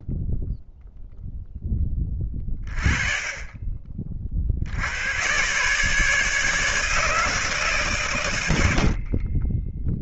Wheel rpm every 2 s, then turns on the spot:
0, 30, 50, 150, 100.
8-10